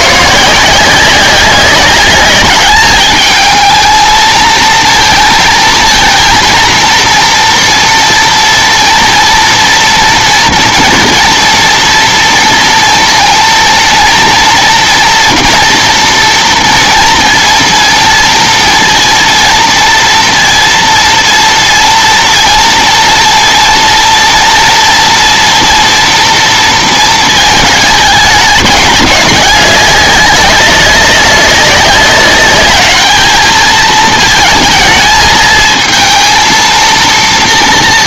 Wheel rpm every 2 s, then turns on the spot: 160, 210, 230, 230, 230, 230, 230, 230, 230, 230, 230, 230, 230, 230, 210, 200, 200, 220, 230.
none